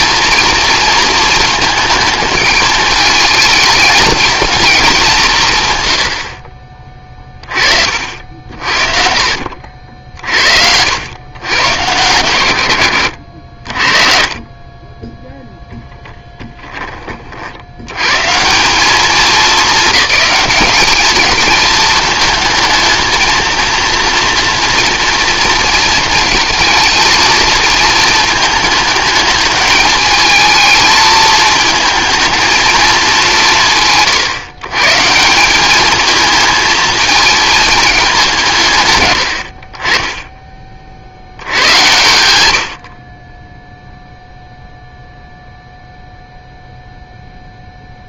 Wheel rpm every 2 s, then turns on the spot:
230, 220, 210, 40, 50, 70, 100, 20, 10, 210, 210, 220, 230, 220, 220, 220, 220, 140, 220, 150, 30, 60, 0, 0.
8-10